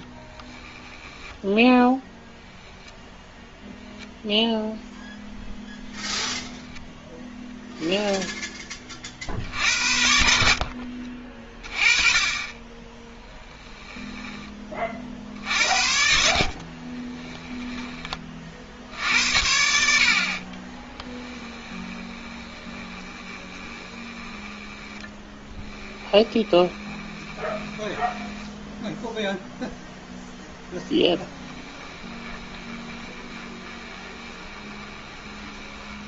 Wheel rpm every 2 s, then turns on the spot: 10, 0, 0, 0, 10, 60, 20, 30, 40, 70, 20, 20, 10, 20, 10, 0, 20, 20.
10-12 16-30 32-36